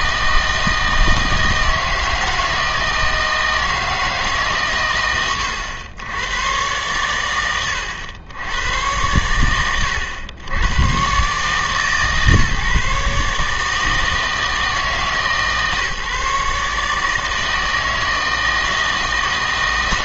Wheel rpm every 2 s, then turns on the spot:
160, 160, 130, 110, 100, 110, 150, 160, 150, 160.
none